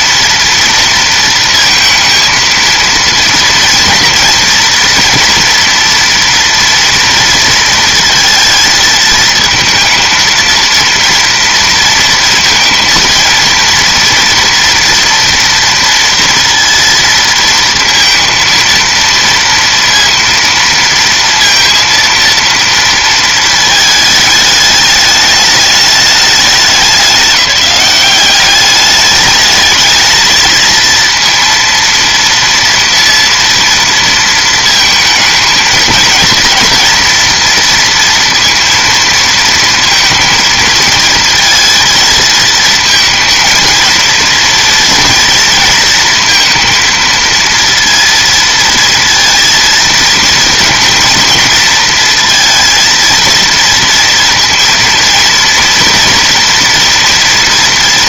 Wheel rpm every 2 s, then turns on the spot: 230, 230, 230, 230, 220, 230, 230, 230, 230, 230, 230, 230, 210, 200, 200, 230, 230, 230, 230, 230, 230, 220, 230, 230, 230, 230, 230, 230, 230.
none